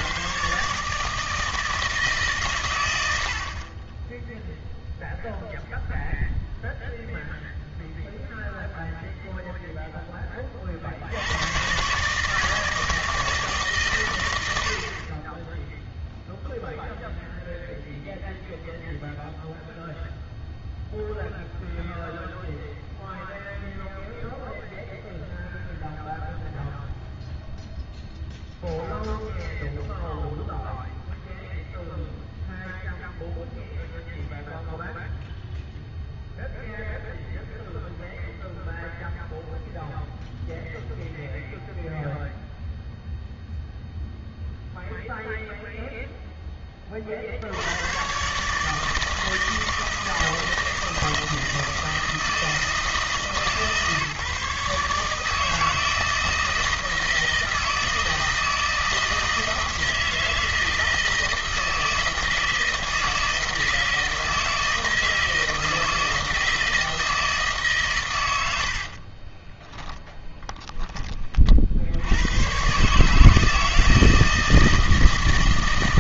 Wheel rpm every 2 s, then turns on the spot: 140, 110, 0, 0, 0, 50, 160, 70, 0, 0, 0, 0, 0, 0, 0, 0, 0, 0, 0, 0, 0, 0, 0, 20, 150, 160, 160, 150, 160, 160, 160, 160, 160, 160, 70, 10, 120, 160.
68-70